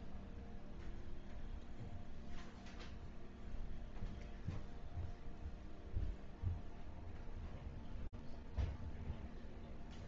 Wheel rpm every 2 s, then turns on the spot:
0, 0, 0, 0, 0.
none